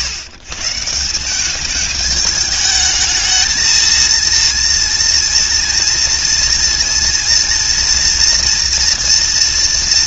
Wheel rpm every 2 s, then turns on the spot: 160, 210, 230, 230, 230.
none